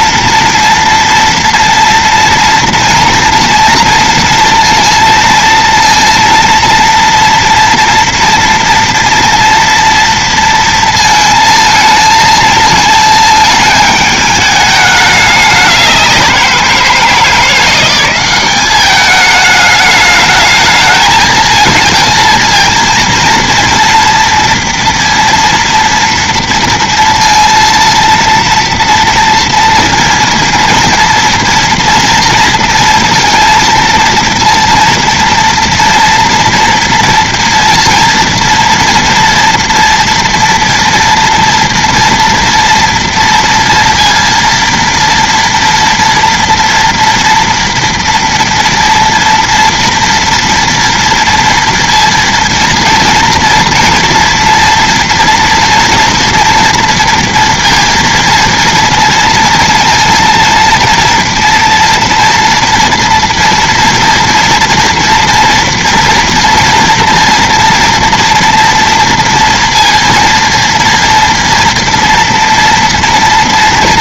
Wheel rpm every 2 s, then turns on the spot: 230, 230, 230, 230, 230, 230, 220, 210, 180, 200, 210, 230, 230, 230, 230, 230, 230, 230, 230, 230, 230, 230, 230, 230, 230, 230, 230, 230, 240, 230, 230, 230, 230, 230, 230, 230, 230.
none